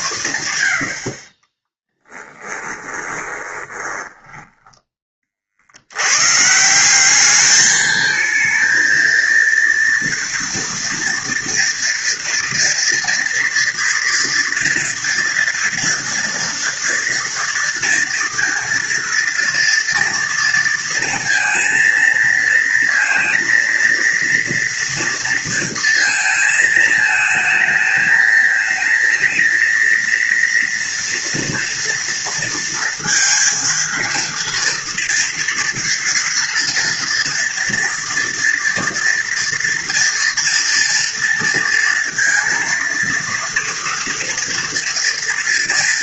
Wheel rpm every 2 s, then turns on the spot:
80, 30, 20, 180, 230, 230, 230, 230, 230, 230, 230, 230, 230, 220, 220, 240, 230, 230, 230, 230, 230, 230, 230.
2-4